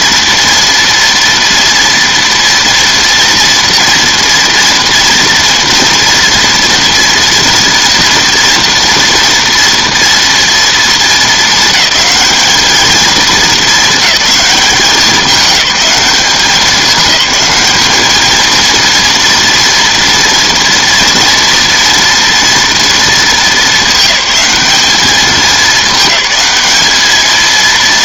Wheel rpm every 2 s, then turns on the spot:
230, 240, 230, 230, 230, 220, 210, 200, 200, 230, 230, 230, 210, 210.
none